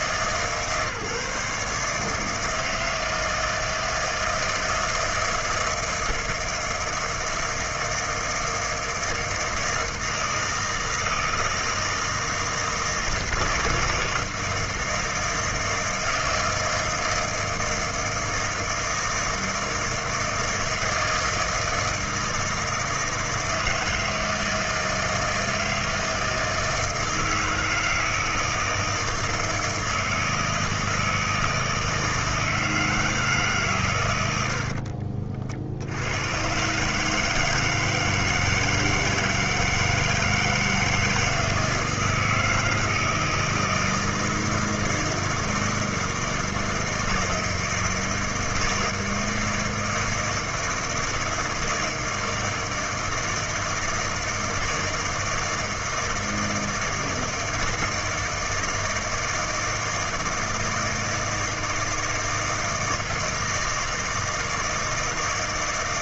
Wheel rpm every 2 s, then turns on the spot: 150, 160, 160, 160, 160, 160, 160, 160, 160, 160, 160, 160, 160, 160, 160, 160, 160, 60, 140, 160, 160, 160, 160, 160, 160, 160, 160, 160, 160, 160, 160, 160, 160.
34-36